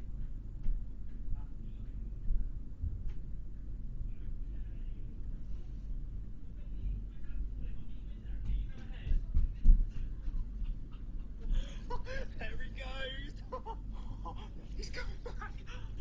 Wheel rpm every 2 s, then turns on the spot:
0, 0, 0, 0, 0, 0, 0, 0.
none